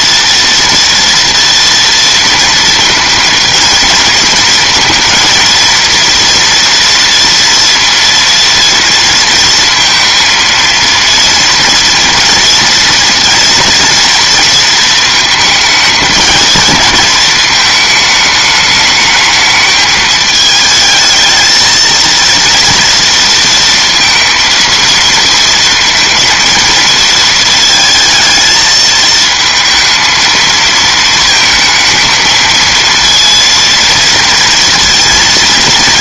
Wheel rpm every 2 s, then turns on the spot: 230, 230, 220, 230, 230, 230, 230, 230, 220, 210, 210, 230, 230, 230, 220, 230, 220, 230.
none